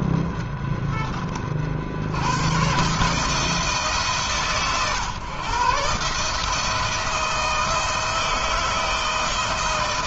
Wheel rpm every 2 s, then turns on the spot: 30, 150, 130, 160, 160.
none